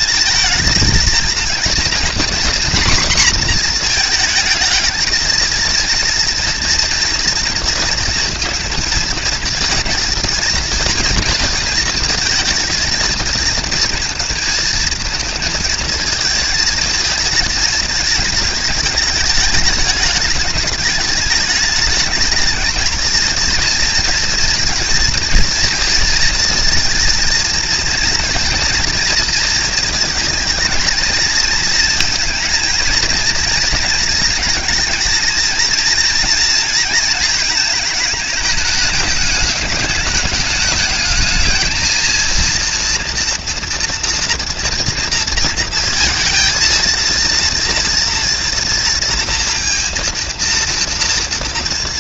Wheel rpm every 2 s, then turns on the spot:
230, 240, 230, 230, 230, 230, 230, 230, 220, 210, 210, 220, 240, 230, 230, 220, 230, 230, 230, 210, 220, 230, 230, 230, 230, 230.
none